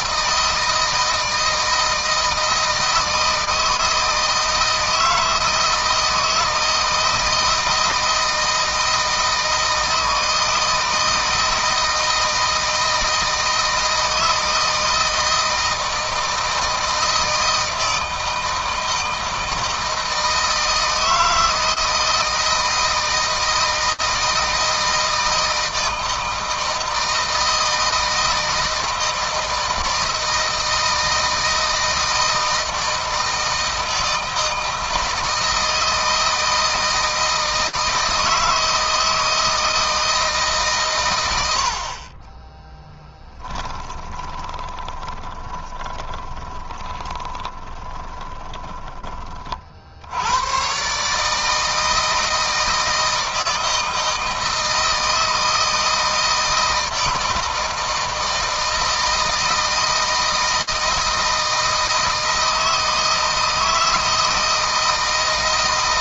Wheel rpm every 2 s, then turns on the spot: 160, 160, 160, 160, 160, 160, 160, 160, 160, 160, 160, 160, 160, 160, 160, 160, 160, 160, 160, 160, 130, 20, 20, 20, 20, 130, 160, 160, 160, 160, 160, 160, 160.
42-48